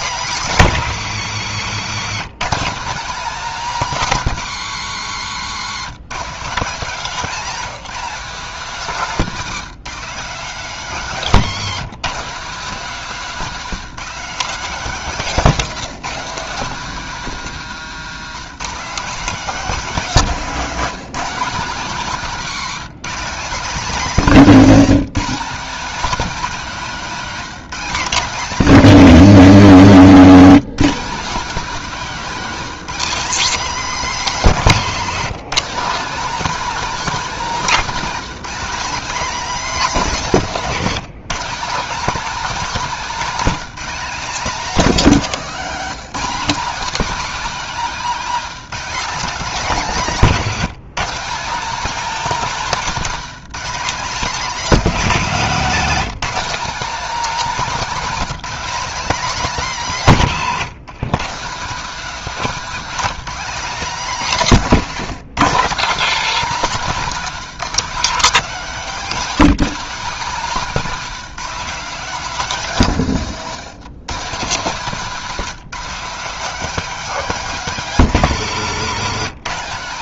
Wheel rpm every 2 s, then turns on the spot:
180, 220, 160, 210, 220, 210, 220, 220, 200, 230, 230, 220, 240, 230, 260, 240, 240, 220, 290, 270, 210, 260, 260, 250, 260, 210, 230, 250, 260, 260, 170, 240, 210, 250, 240, 230, 180, 220, 270, 200.
34-36